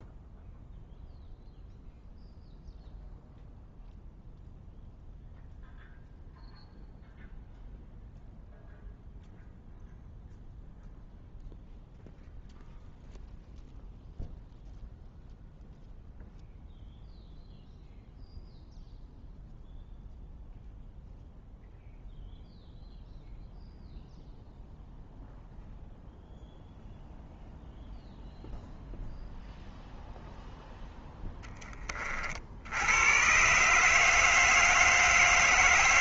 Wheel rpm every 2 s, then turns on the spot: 0, 0, 0, 0, 0, 0, 0, 0, 0, 0, 0, 0, 0, 0, 0, 10, 120, 160.
none